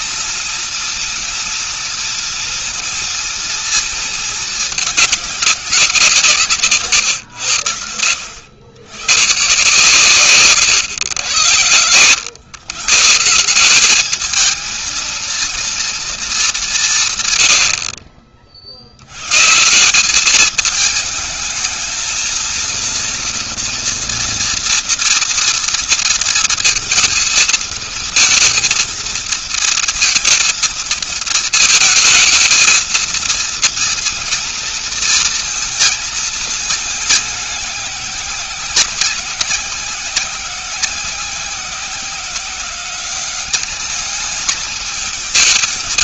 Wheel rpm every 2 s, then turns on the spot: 240, 230, 200, 130, 110, 110, 150, 230, 140, 90, 220, 230, 230, 230, 230, 220, 230, 230, 210, 190, 180, 190, 220.
16-18